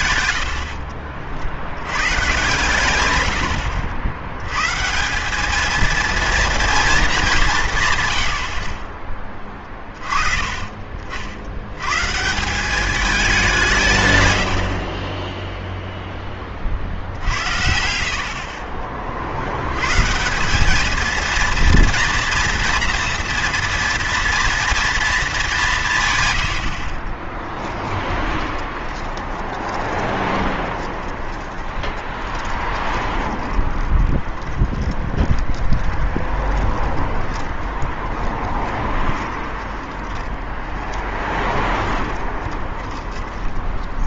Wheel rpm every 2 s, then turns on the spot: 70, 130, 130, 230, 30, 40, 190, 70, 50, 30, 210, 230, 230, 60, 20, 20, 30, 30, 20, 20, 30, 20.
0-2 28-44